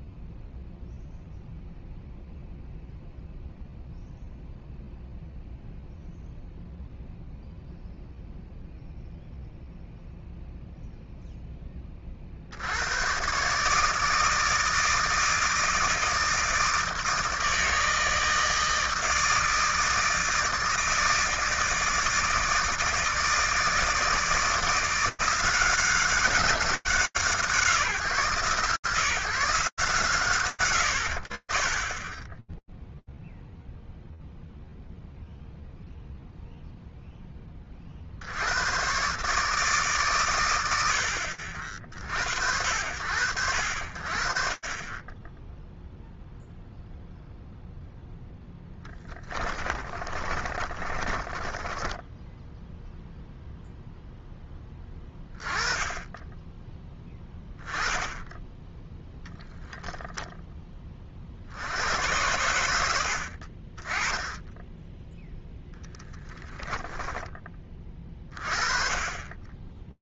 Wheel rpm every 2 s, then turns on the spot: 0, 0, 0, 0, 0, 20, 150, 160, 160, 160, 160, 160, 180, 150, 150, 70, 0, 0, 40, 130, 50, 40, 0, 0, 20, 10, 0, 20, 10, 10, 60, 60, 0, 10, 20.
48-52